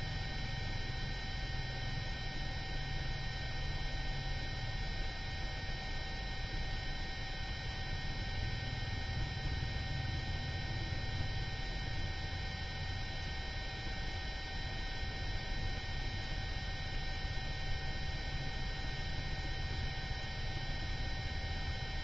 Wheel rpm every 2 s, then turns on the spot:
0, 0, 0, 0, 0, 0, 0, 0, 0, 0, 0.
none